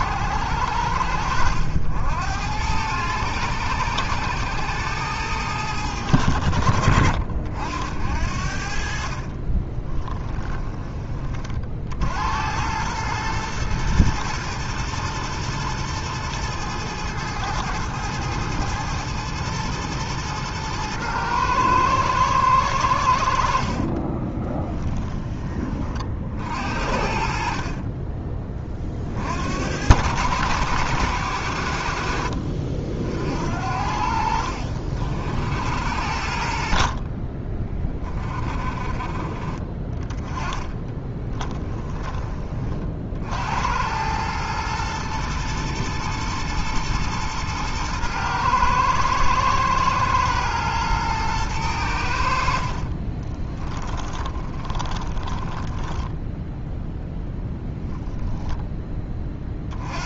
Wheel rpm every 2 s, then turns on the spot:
80, 90, 100, 60, 50, 10, 100, 120, 110, 110, 110, 90, 20, 50, 30, 90, 60, 60, 40, 30, 20, 40, 110, 110, 110, 110, 50, 20, 10, 10.
40-42 52-56